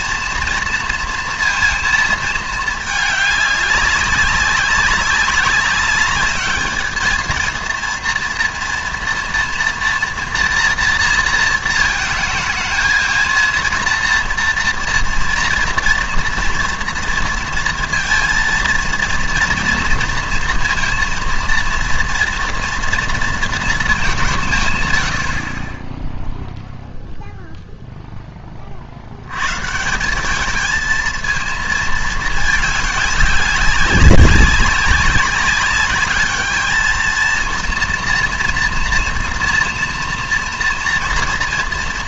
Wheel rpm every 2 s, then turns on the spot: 230, 210, 190, 210, 240, 240, 220, 230, 230, 230, 230, 230, 140, 0, 40, 210, 210, 190, 210, 230, 230.
none